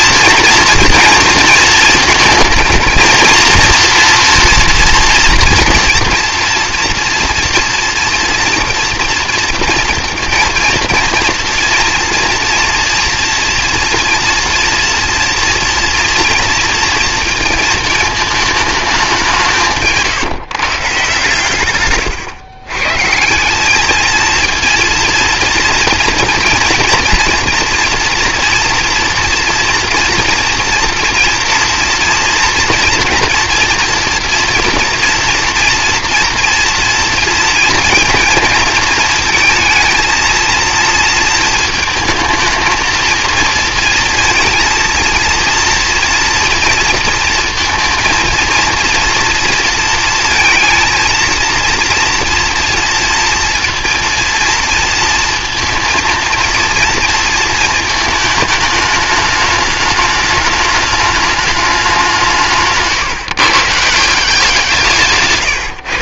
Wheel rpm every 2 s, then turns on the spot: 230, 230, 230, 230, 240, 230, 230, 230, 230, 210, 150, 130, 230, 230, 230, 230, 230, 230, 230, 230, 230, 220, 230, 230, 230, 230, 230, 230, 230, 210, 210, 150, 180.
none